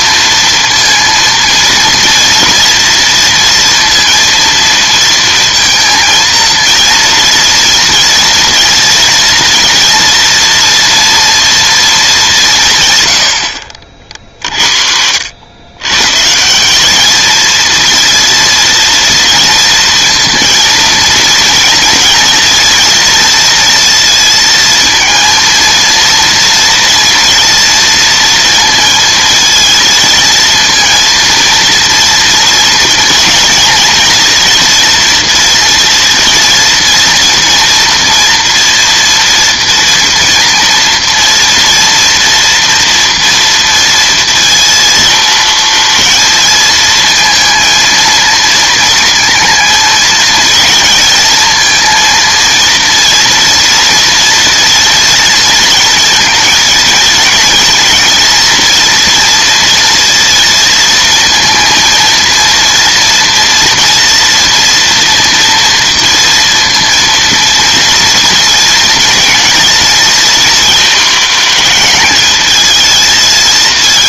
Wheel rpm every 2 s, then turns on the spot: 230, 230, 230, 230, 230, 230, 140, 60, 200, 230, 230, 230, 230, 230, 230, 230, 230, 230, 230, 230, 230, 230, 230, 220, 230, 230, 230, 230, 230, 230, 230, 230, 230, 230, 230, 230, 220.
none